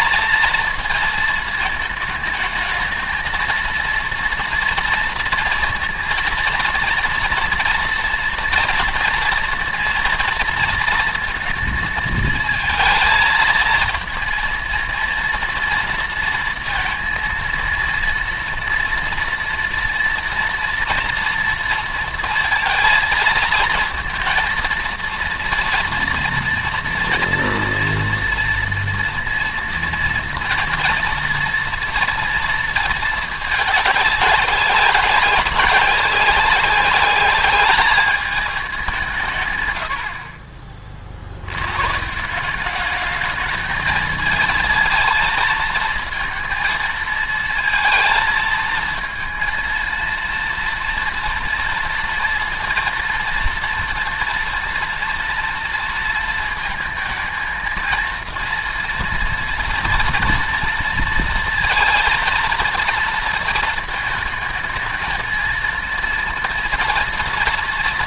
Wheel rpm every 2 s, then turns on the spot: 230, 220, 230, 230, 230, 230, 220, 230, 230, 230, 230, 230, 230, 230, 230, 230, 230, 190, 190, 200, 50, 190, 230, 230, 220, 230, 230, 230, 230, 230, 230, 230, 220, 230.
none